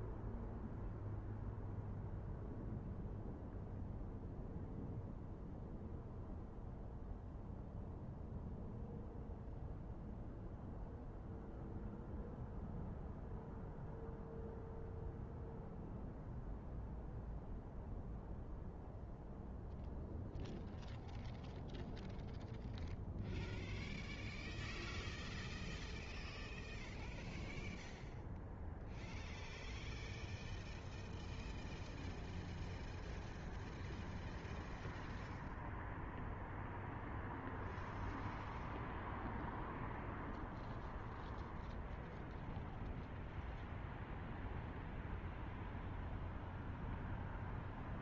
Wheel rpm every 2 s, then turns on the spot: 0, 0, 0, 0, 0, 0, 0, 0, 0, 0, 0, 0, 0, 0, 0, 0, 0, 0, 0, 0, 0, 0, 0, 0.
none